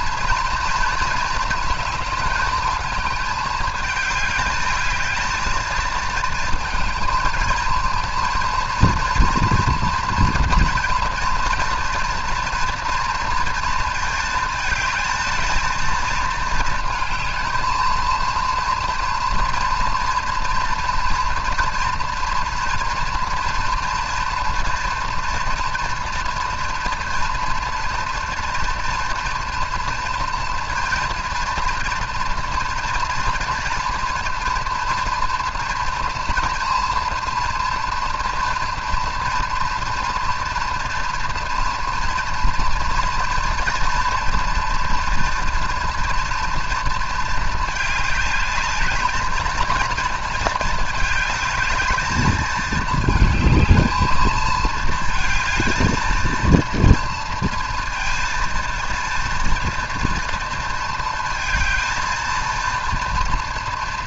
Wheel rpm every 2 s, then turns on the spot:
230, 220, 210, 230, 230, 230, 230, 220, 220, 230, 230, 230, 240, 240, 230, 230, 230, 240, 230, 230, 230, 230, 230, 230, 210, 230, 220, 220, 230, 230, 230, 230.
none